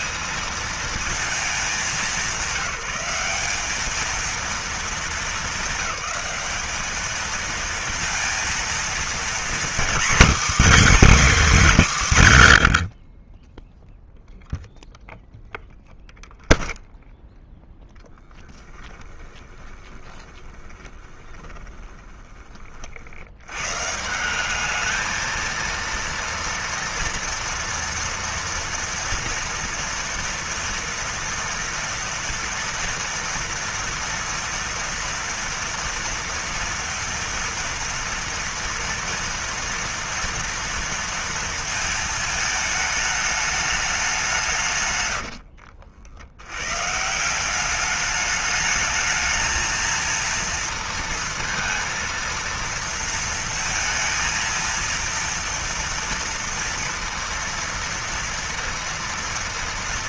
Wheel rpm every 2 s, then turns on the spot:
220, 190, 220, 220, 230, 280, 140, 0, 0, 10, 20, 40, 210, 230, 230, 230, 240, 230, 230, 230, 230, 220, 160, 110, 210, 230, 230, 230, 230, 230.
18-22